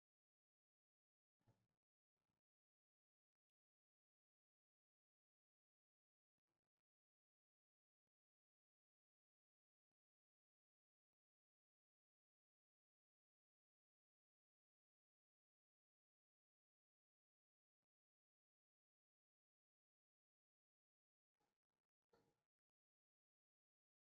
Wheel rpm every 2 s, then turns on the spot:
0, 0, 0, 0, 0, 0, 0, 0, 0, 0, 0, 0.
none